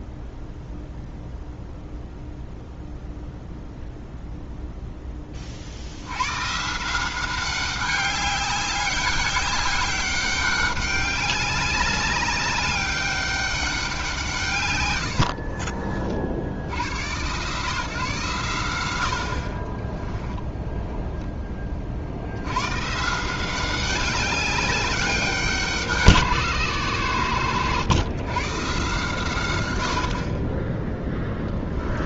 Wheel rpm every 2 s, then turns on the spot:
0, 0, 10, 160, 200, 200, 200, 110, 90, 100, 10, 130, 200, 80, 130, 10.
14-16